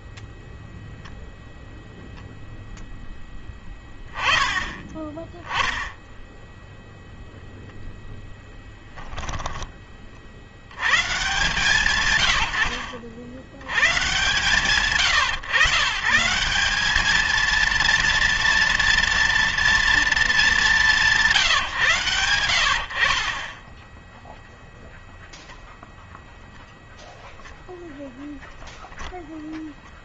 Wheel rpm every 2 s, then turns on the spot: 0, 0, 20, 0, 10, 70, 70, 140, 180, 240, 210, 80, 0, 0, 0.
8-10